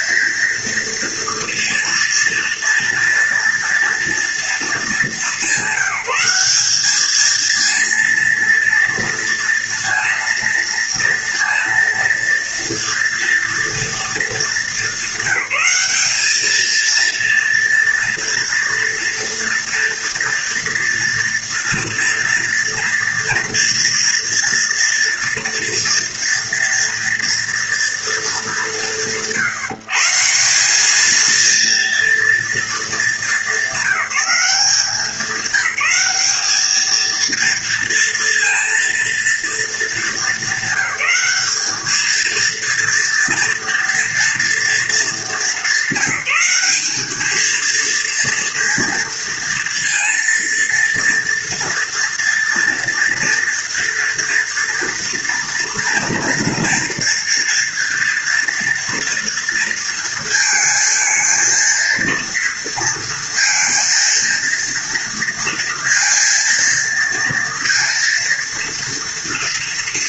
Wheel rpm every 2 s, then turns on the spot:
230, 230, 200, 220, 230, 230, 230, 200, 230, 230, 230, 230, 230, 230, 140, 230, 210, 190, 230, 230, 210, 230, 210, 210, 230, 230, 230, 230, 230, 240, 230, 230, 230, 230, 230.
none